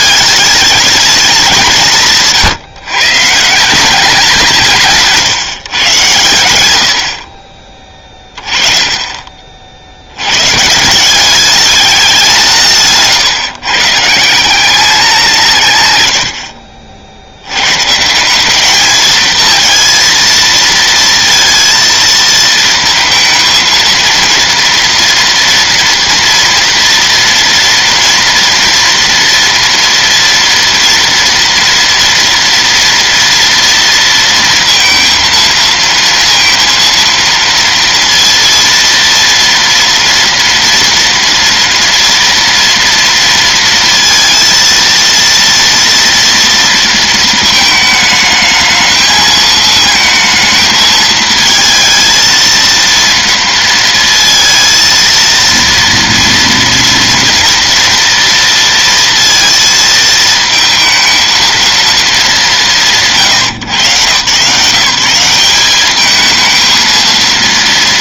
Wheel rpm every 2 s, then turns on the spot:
210, 140, 160, 100, 30, 140, 160, 190, 60, 200, 230, 230, 230, 240, 230, 230, 230, 230, 230, 230, 230, 230, 230, 230, 220, 220, 230, 230, 230, 230, 220, 140, 170, 220.
none